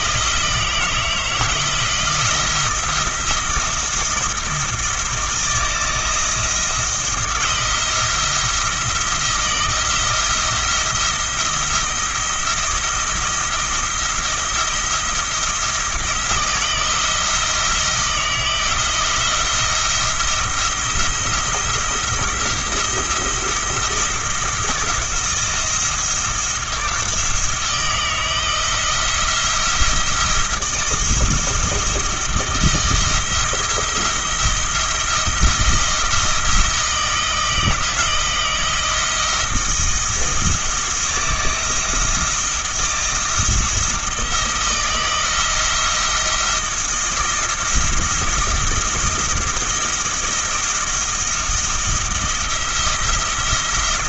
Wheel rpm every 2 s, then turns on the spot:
160, 170, 170, 160, 170, 170, 170, 170, 160, 170, 170, 170, 170, 170, 170, 170, 170, 170, 160, 160, 160, 170, 170, 170, 170, 160, 170.
none